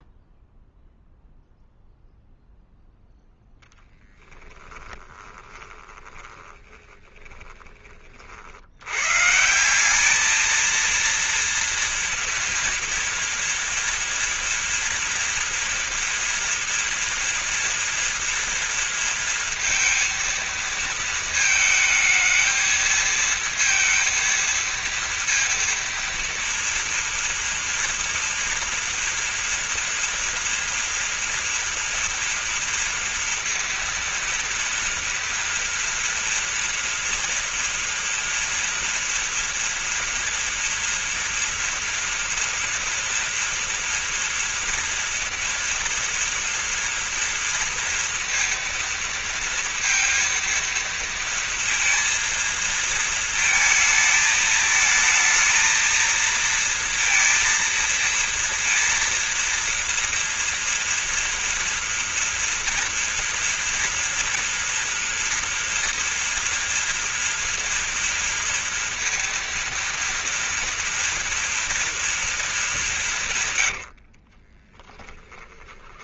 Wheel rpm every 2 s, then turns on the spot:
0, 0, 10, 20, 90, 230, 230, 230, 230, 230, 230, 220, 230, 230, 230, 230, 240, 230, 240, 230, 230, 230, 230, 230, 230, 230, 230, 220, 230, 230, 240, 230, 240, 230, 230, 230, 200, 20.
4-8 74-76